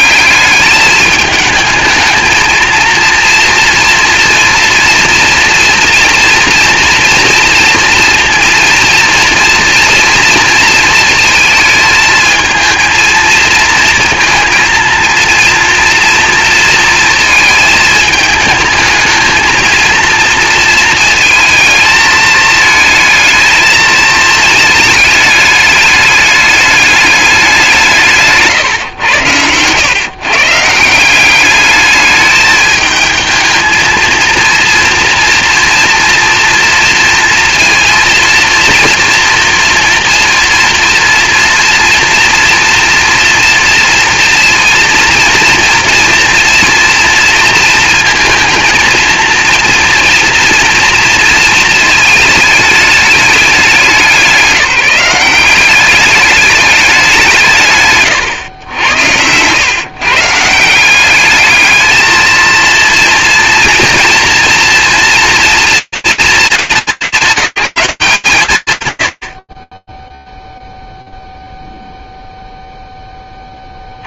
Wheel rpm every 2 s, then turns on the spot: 210, 230, 230, 240, 230, 220, 230, 230, 230, 220, 220, 220, 210, 210, 120, 170, 220, 230, 230, 230, 230, 230, 230, 230, 230, 230, 210, 180, 190, 90, 190, 230, 230, 200, 130, 0, 10.
none